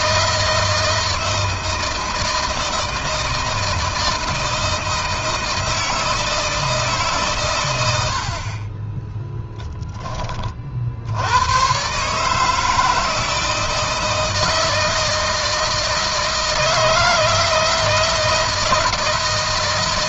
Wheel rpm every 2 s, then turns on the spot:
160, 160, 160, 140, 10, 70, 160, 160, 160, 160.
8-10